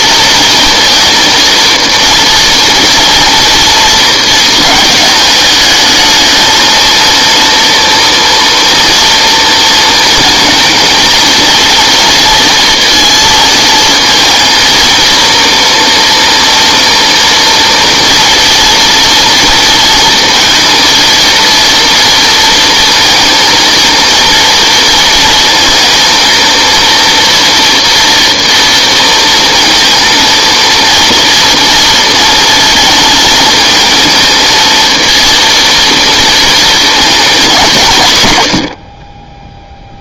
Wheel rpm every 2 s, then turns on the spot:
230, 230, 220, 230, 230, 230, 230, 230, 230, 230, 230, 230, 230, 230, 230, 230, 230, 230, 230, 80.
none